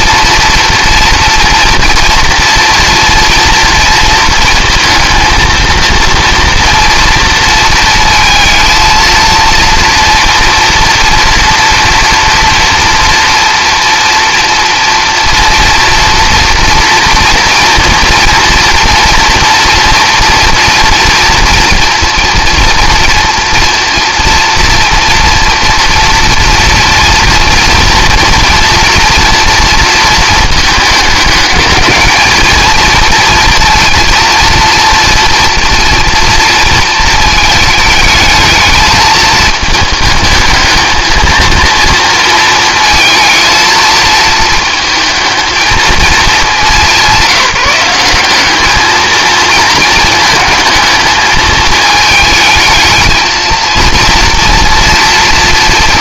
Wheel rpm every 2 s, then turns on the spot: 230, 230, 230, 230, 230, 240, 230, 230, 230, 230, 230, 240, 230, 230, 230, 220, 220, 230, 220, 220, 220, 230, 220, 200, 220, 220, 220, 230.
none